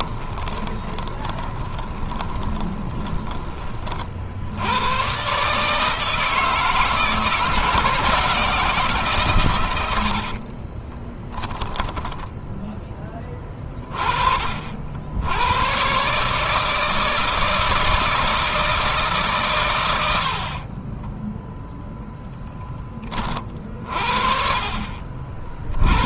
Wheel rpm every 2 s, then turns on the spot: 20, 20, 100, 160, 160, 40, 20, 60, 160, 150, 40, 20, 50.
0-4 10-12 20-22